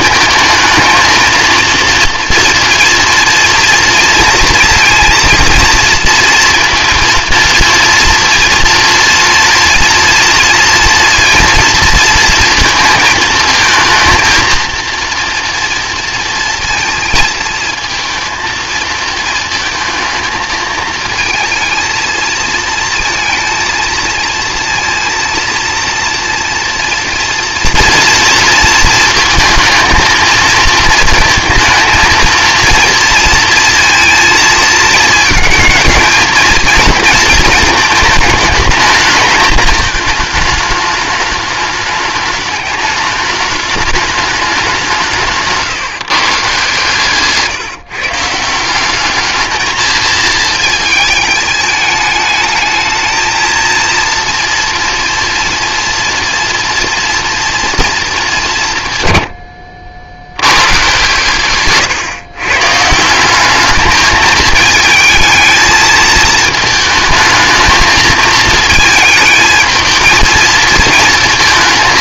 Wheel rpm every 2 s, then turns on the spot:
230, 230, 230, 230, 230, 230, 230, 230, 230, 220, 220, 230, 230, 230, 230, 220, 230, 220, 230, 220, 210, 210, 200, 140, 180, 220, 220, 240, 230, 150, 110, 150, 220, 220, 220, 220.
none